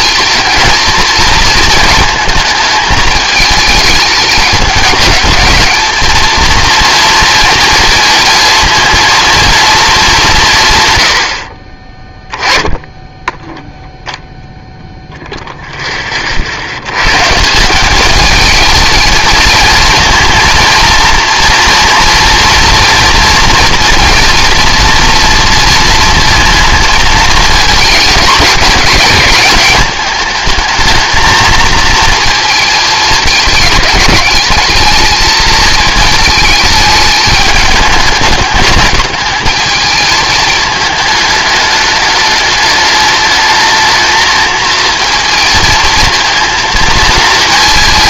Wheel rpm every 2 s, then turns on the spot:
230, 220, 210, 240, 230, 130, 10, 0, 90, 220, 230, 240, 230, 220, 210, 220, 220, 220, 220, 210, 220, 210, 230, 230.
none